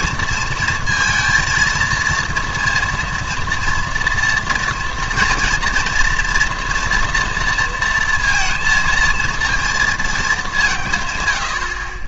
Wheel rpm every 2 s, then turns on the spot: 230, 230, 240, 230, 230, 180.
none